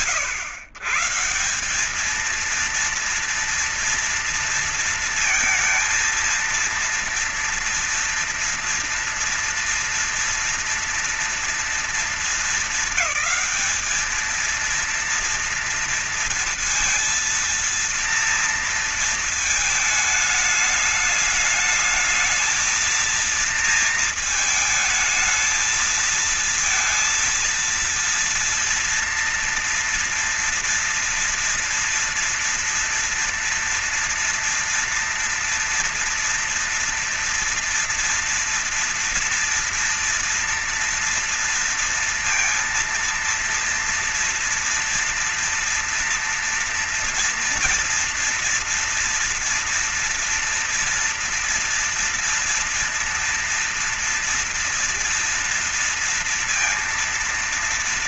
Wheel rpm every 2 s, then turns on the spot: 140, 230, 230, 230, 230, 230, 220, 230, 230, 230, 220, 230, 220, 230, 230, 230, 230, 230, 230, 230, 230, 230, 230, 230, 230, 230, 230, 230, 230.
none